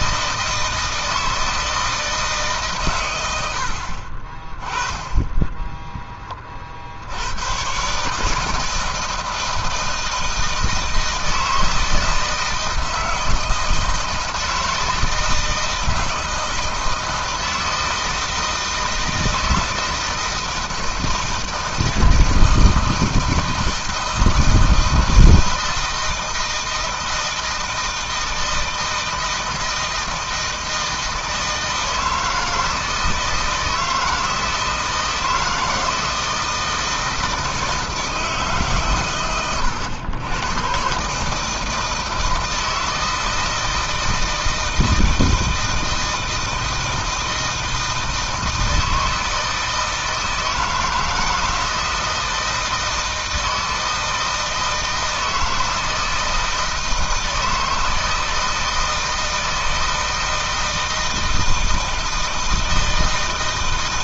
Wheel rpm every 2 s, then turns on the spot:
170, 140, 30, 30, 150, 160, 160, 160, 160, 160, 160, 160, 160, 160, 160, 160, 160, 160, 160, 150, 110, 160, 160, 160, 160, 160, 160, 160, 160, 160, 160, 160.
none